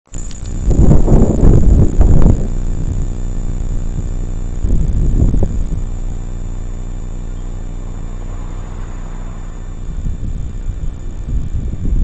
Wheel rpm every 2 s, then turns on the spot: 0, 0, 0, 0, 0, 0.
none